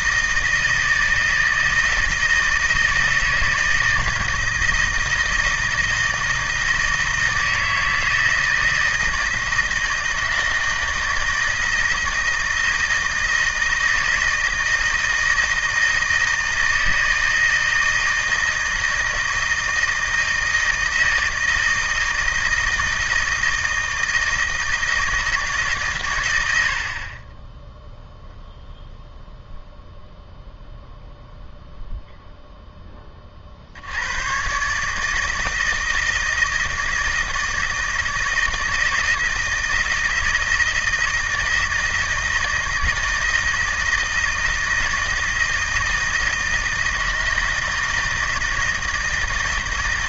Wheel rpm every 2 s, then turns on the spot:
160, 160, 160, 160, 160, 160, 160, 160, 160, 160, 160, 160, 160, 70, 0, 0, 10, 140, 160, 160, 160, 160, 160, 160, 160.
none